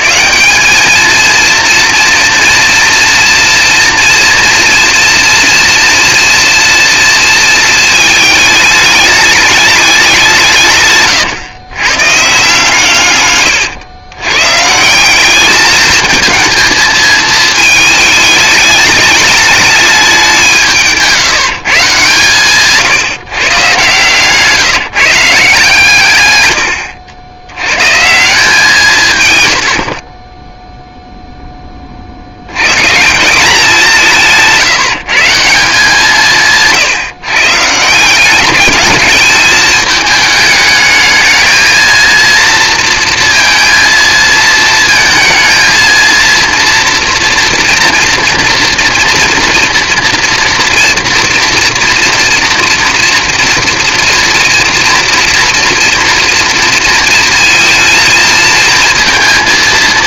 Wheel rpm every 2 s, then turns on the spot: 100, 230, 230, 230, 220, 190, 140, 120, 220, 210, 200, 140, 140, 120, 170, 20, 100, 180, 160, 200, 220, 230, 230, 230, 230, 230, 230, 230, 230, 220.
none